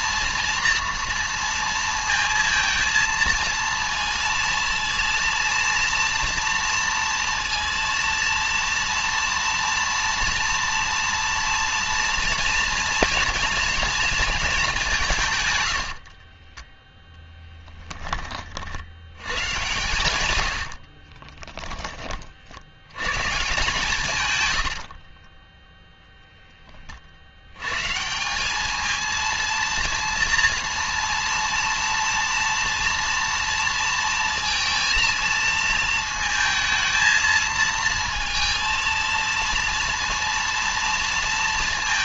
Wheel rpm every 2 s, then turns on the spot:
230, 220, 230, 230, 230, 230, 230, 210, 20, 60, 80, 70, 90, 20, 210, 230, 230, 230, 220, 230, 230.
16-18 20-22 24-26